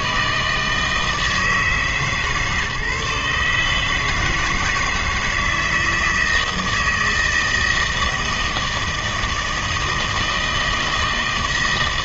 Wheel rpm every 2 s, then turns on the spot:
160, 150, 160, 160, 160, 160.
none